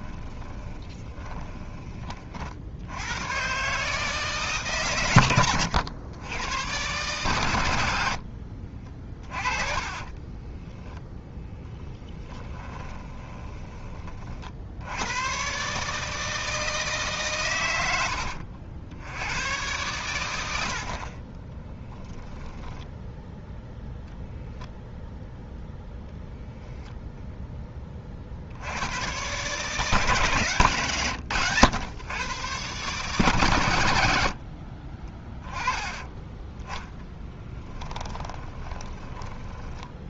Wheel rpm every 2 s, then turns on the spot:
20, 70, 130, 120, 30, 10, 20, 80, 160, 70, 70, 10, 0, 0, 90, 130, 130, 40, 10, 20.
0-2 8-14 22-24 38-40